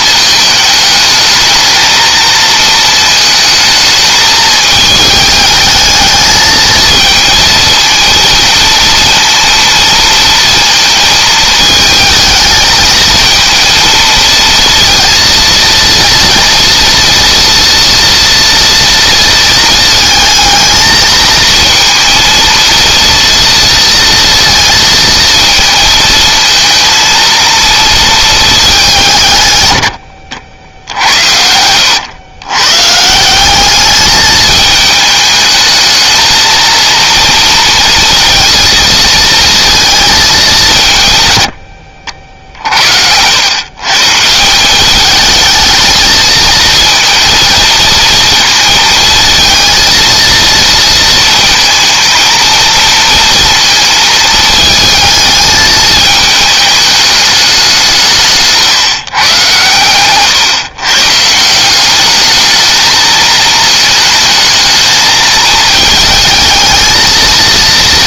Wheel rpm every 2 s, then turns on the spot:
220, 220, 220, 220, 230, 220, 220, 230, 230, 230, 220, 230, 230, 230, 160, 90, 160, 220, 230, 230, 130, 70, 210, 230, 230, 230, 230, 220, 210, 130, 140, 220, 220, 230.
none